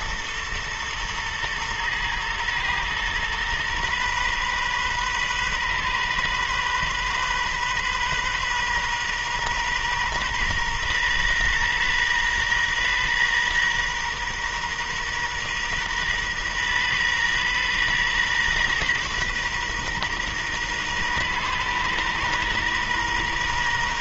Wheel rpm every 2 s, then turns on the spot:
120, 120, 130, 130, 130, 120, 120, 120, 120, 120, 120, 120.
none